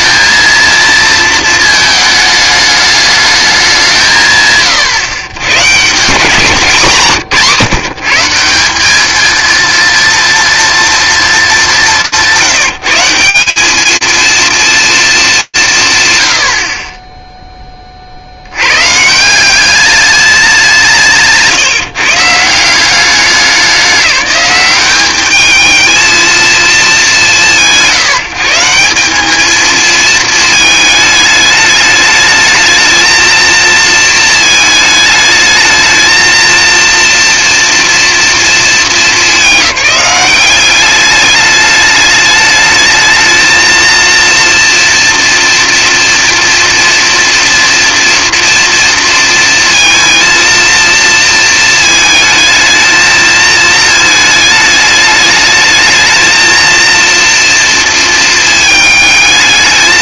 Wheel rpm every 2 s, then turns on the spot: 230, 210, 140, 170, 180, 240, 180, 220, 20, 120, 180, 180, 200, 210, 180, 220, 220, 220, 230, 210, 190, 210, 230, 230, 230, 230, 220, 210, 230, 220.
none